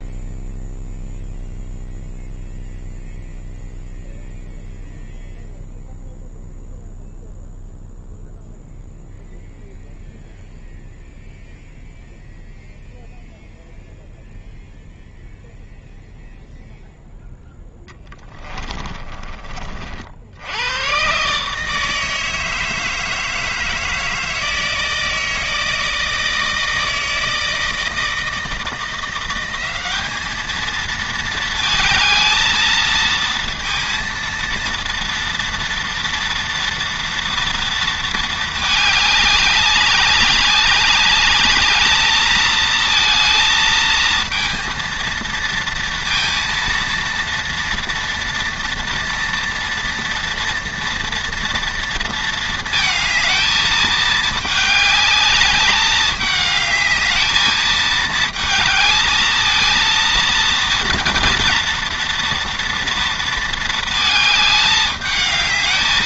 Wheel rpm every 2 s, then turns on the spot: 0, 0, 0, 0, 0, 0, 0, 0, 0, 40, 140, 160, 160, 160, 180, 220, 230, 230, 230, 200, 210, 230, 230, 230, 230, 230, 220, 210, 220, 220, 230, 230, 210.
none